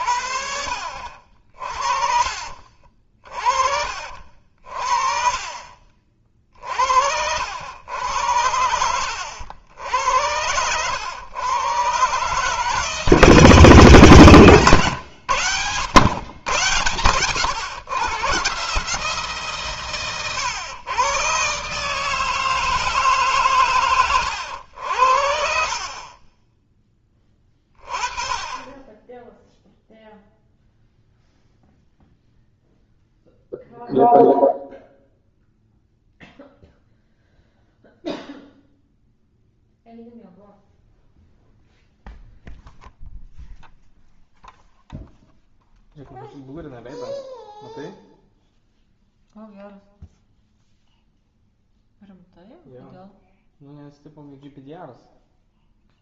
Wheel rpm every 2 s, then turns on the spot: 60, 50, 50, 60, 90, 90, 150, 130, 110, 140, 120, 160, 80, 20, 20, 0, 0, 0, 0, 0, 0, 0, 0, 0, 0, 0, 0, 0.
none